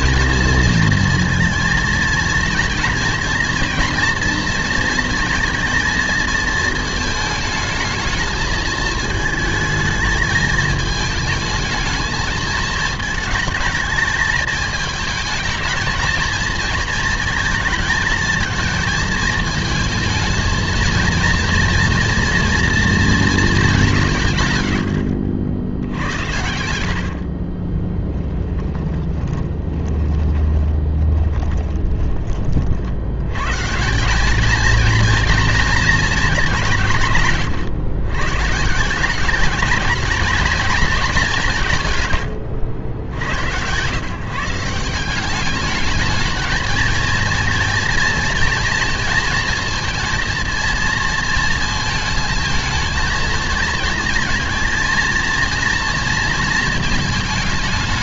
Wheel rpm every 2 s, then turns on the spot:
230, 230, 230, 220, 220, 220, 220, 220, 230, 230, 230, 240, 90, 90, 10, 20, 60, 230, 160, 170, 220, 90, 170, 220, 230, 230, 220, 230, 230.
24-32